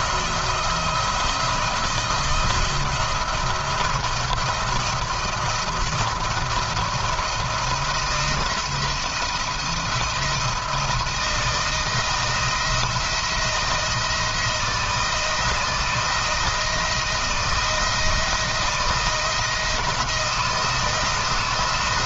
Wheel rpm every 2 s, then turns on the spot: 170, 170, 170, 170, 170, 170, 170, 170, 160, 170, 160.
none